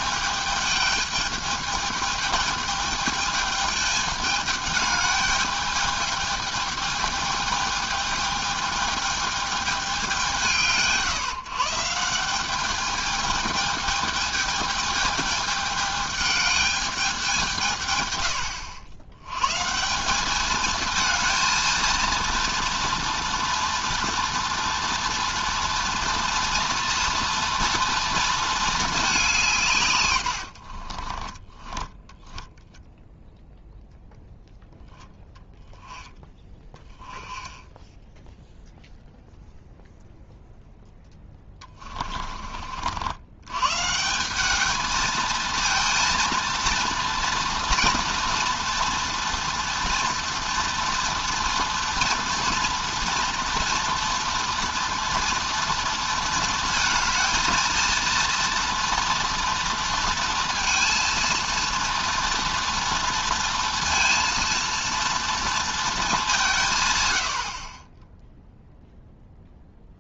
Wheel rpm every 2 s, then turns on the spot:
210, 220, 210, 210, 210, 140, 200, 220, 210, 80, 220, 240, 230, 230, 220, 60, 0, 0, 10, 0, 0, 50, 210, 230, 230, 230, 230, 230, 220, 230, 230, 230, 230, 150, 0.
30-32 36-38